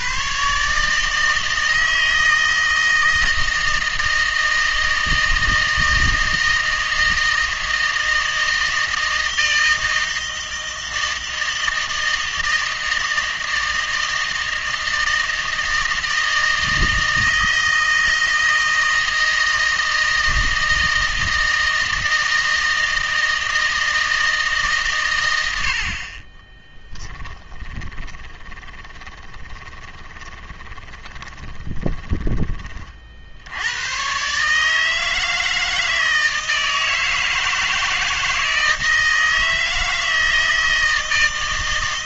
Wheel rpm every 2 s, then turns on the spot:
140, 160, 160, 160, 160, 160, 160, 160, 160, 160, 160, 160, 140, 10, 20, 20, 30, 150, 160, 160, 160.
26-32